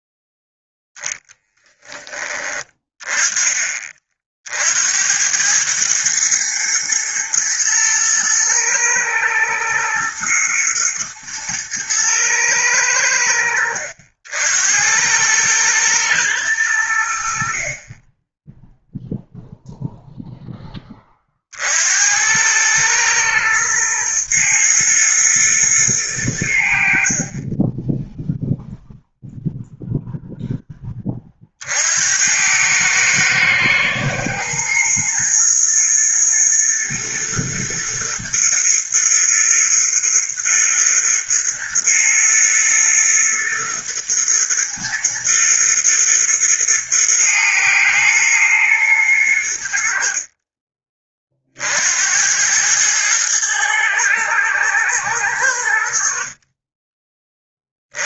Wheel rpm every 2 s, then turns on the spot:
10, 20, 80, 120, 110, 110, 90, 90, 80, 0, 20, 110, 110, 60, 0, 20, 110, 120, 120, 110, 110, 110, 110, 110, 110, 30, 110, 110, 20.
none